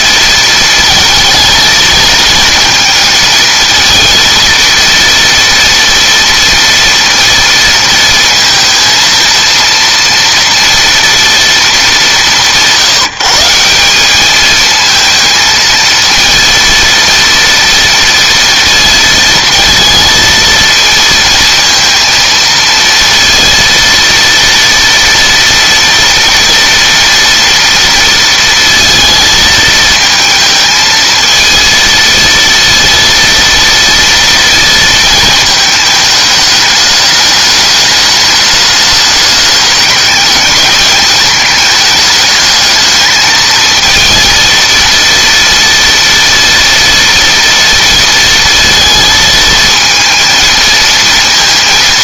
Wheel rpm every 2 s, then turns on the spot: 230, 220, 230, 230, 230, 230, 170, 220, 230, 230, 230, 230, 230, 230, 230, 230, 230, 220, 210, 210, 200, 210, 230, 230, 230, 230.
none